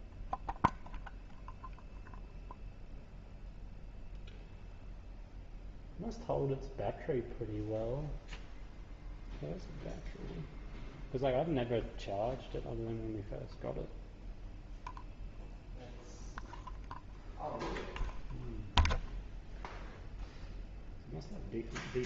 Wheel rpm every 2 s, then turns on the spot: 0, 0, 0, 0, 0, 0, 0, 0, 0, 0, 0.
none